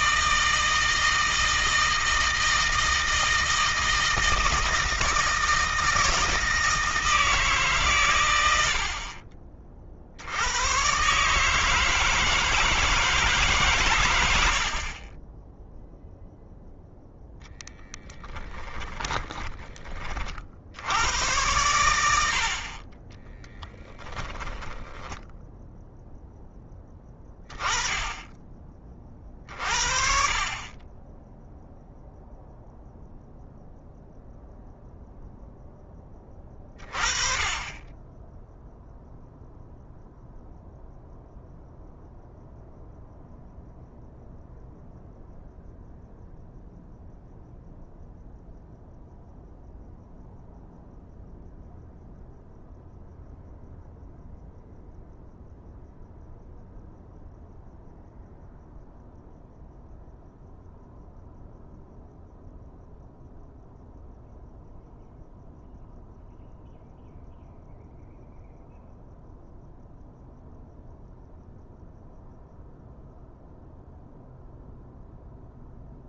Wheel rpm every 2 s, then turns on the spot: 160, 160, 160, 160, 90, 110, 160, 50, 0, 20, 80, 40, 10, 10, 30, 30, 0, 0, 30, 0, 0, 0, 0, 0, 0, 0, 0, 0, 0, 0, 0, 0, 0, 0, 0, 0, 0, 0.
18-20